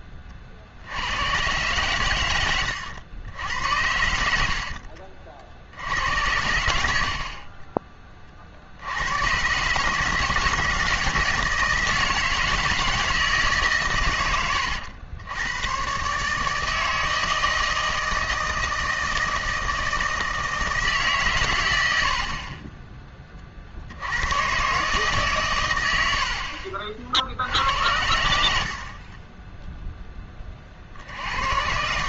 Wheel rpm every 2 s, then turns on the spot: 60, 100, 60, 90, 60, 160, 160, 90, 160, 160, 160, 30, 130, 60, 60, 40.
2-6 26-28